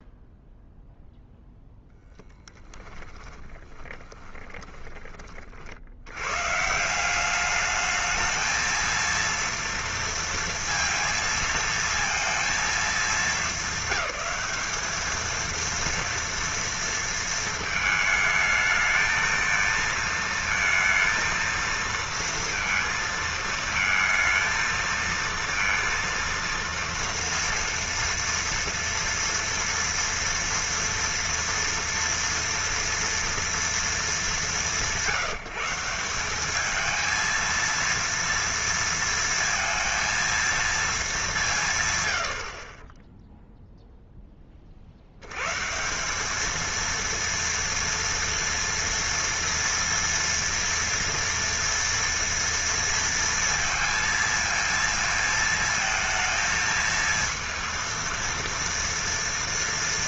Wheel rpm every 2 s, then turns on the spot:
0, 10, 20, 150, 230, 230, 230, 210, 230, 220, 230, 230, 230, 230, 230, 230, 230, 180, 210, 230, 230, 130, 50, 220, 230, 230, 230, 230, 220, 230.
2-6